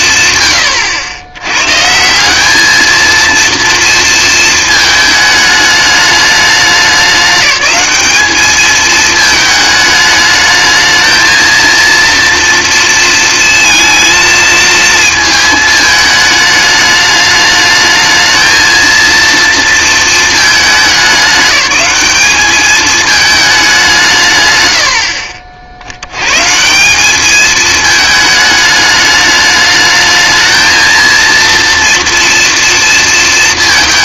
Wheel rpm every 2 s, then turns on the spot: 90, 220, 220, 200, 220, 220, 230, 220, 210, 230, 210, 210, 100, 170, 210, 230, 230.
none